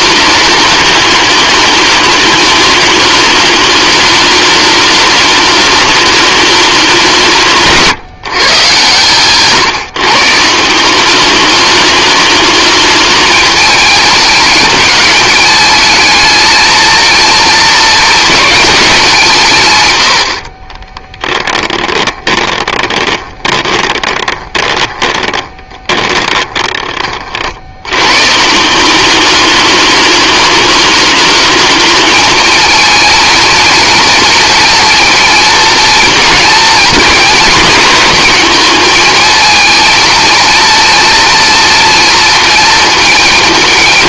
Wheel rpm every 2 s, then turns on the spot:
210, 210, 210, 190, 130, 180, 210, 210, 230, 200, 40, 20, 20, 30, 190, 210, 230, 230, 220, 220, 230, 230.
20-26